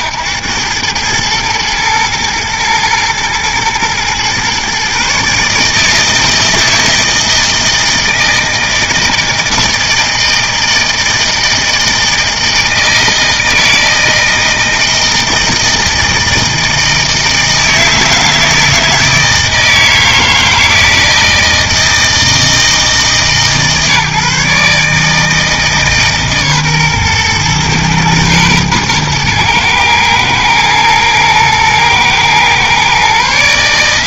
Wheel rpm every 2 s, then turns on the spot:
110, 110, 130, 160, 160, 160, 160, 160, 160, 160, 160, 160, 150, 130, 110, 110, 130.
none